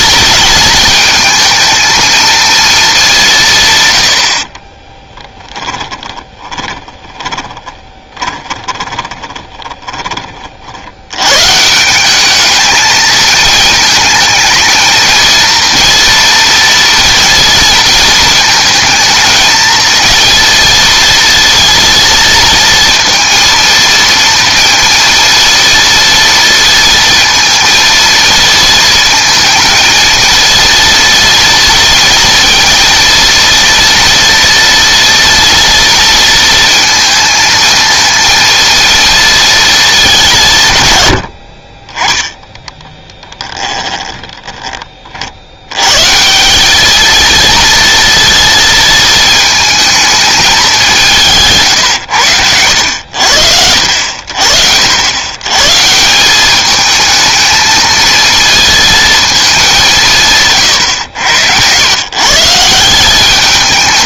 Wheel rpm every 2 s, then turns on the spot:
220, 220, 30, 10, 20, 60, 220, 220, 230, 220, 230, 230, 230, 230, 230, 230, 230, 230, 230, 230, 130, 10, 30, 200, 230, 190, 90, 70, 210, 230, 130, 170.
4-10 42-44